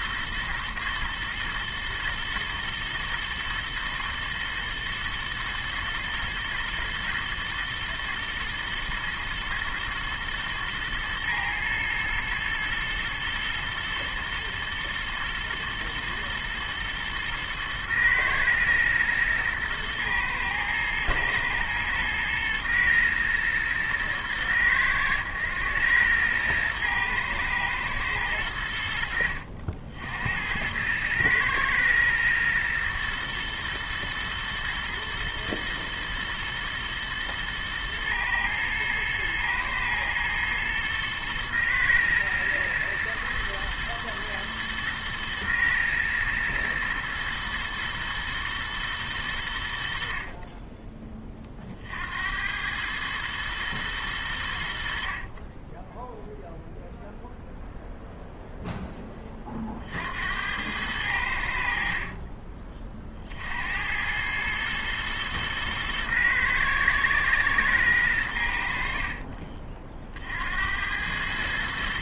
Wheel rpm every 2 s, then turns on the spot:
110, 120, 120, 120, 120, 110, 110, 110, 110, 110, 110, 110, 100, 110, 90, 90, 120, 110, 110, 110, 110, 120, 110, 120, 120, 30, 100, 70, 0, 10, 90, 40, 110, 110, 70, 80.
none